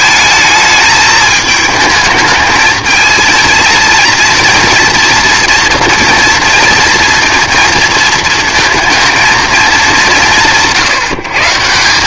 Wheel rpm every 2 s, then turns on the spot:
210, 220, 230, 230, 230, 160.
none